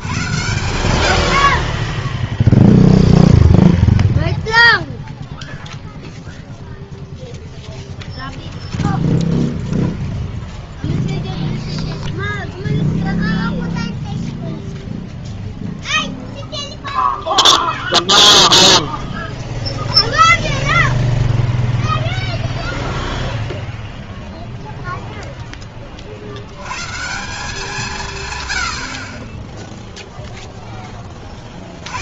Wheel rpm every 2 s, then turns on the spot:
60, 0, 0, 0, 0, 0, 0, 0, 0, 0, 0, 0, 100, 110, 0, 190.
none